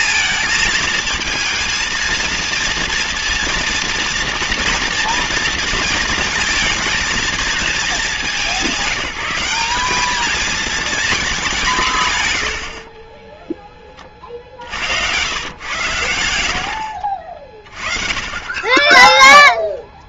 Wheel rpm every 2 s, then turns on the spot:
230, 230, 230, 230, 200, 220, 80, 70, 90, 30.
12-14